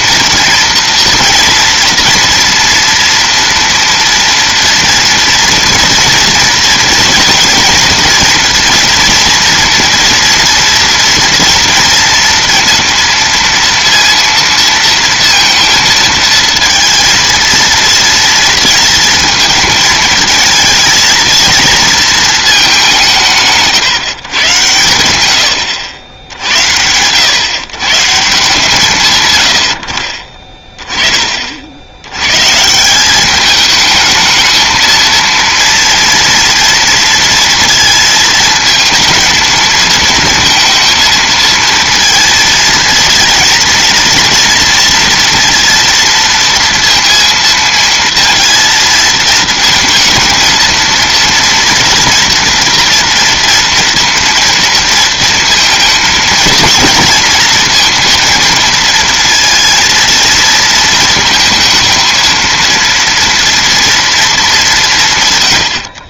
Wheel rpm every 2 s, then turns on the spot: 230, 230, 230, 230, 230, 230, 230, 230, 230, 230, 220, 200, 110, 80, 150, 20, 150, 220, 230, 220, 230, 230, 230, 230, 230, 230, 230, 230, 220, 230, 220, 230, 190.
none